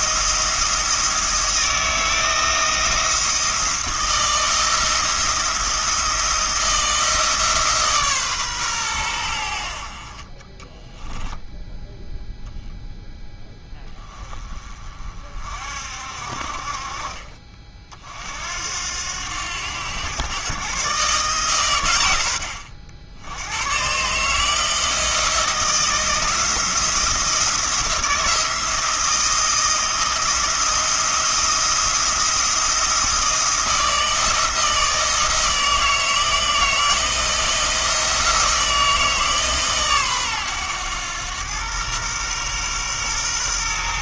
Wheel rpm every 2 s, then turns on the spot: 160, 170, 170, 160, 110, 20, 0, 30, 40, 80, 130, 70, 160, 170, 160, 170, 170, 160, 160, 160, 110, 120.
10-12